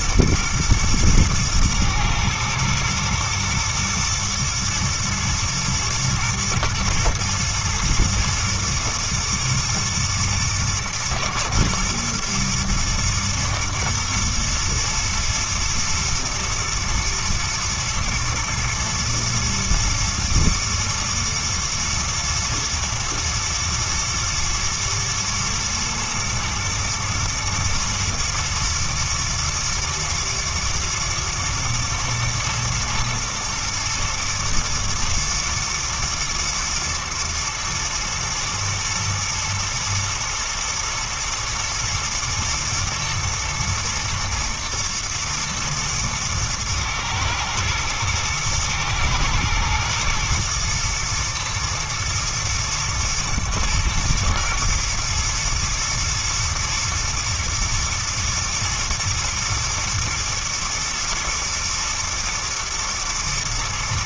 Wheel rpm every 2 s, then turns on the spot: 110, 120, 120, 110, 110, 110, 110, 110, 110, 110, 110, 120, 110, 110, 110, 110, 110, 120, 110, 110, 110, 110, 110, 110, 110, 120, 120, 110, 120, 120, 120, 120.
none